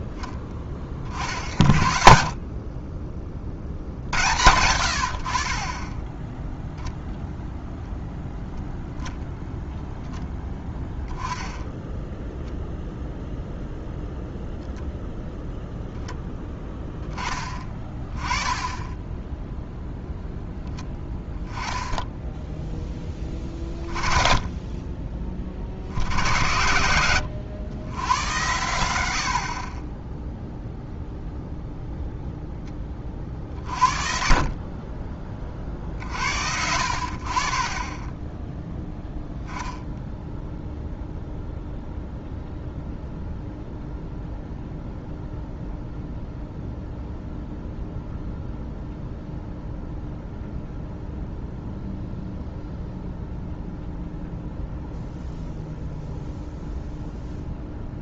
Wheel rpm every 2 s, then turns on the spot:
30, 30, 80, 0, 0, 20, 0, 0, 10, 10, 0, 10, 30, 90, 90, 0, 20, 30, 70, 10, 0, 0, 0, 0, 0, 0, 0, 0, 0.
none